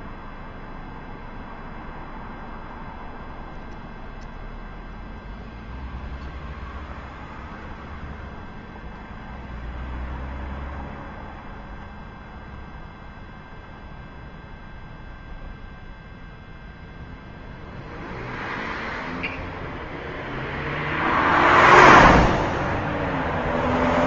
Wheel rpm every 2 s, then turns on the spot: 0, 0, 0, 0, 0, 0, 0, 0, 0, 0, 0, 0.
none